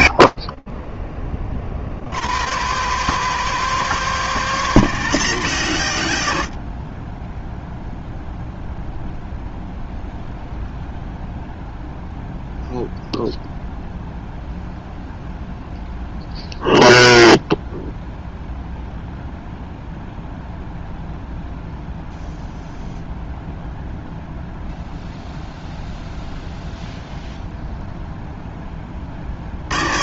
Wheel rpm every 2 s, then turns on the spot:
200, 100, 0, 0, 0, 0, 0, 0, 0, 0, 0, 0, 0, 10, 160.
none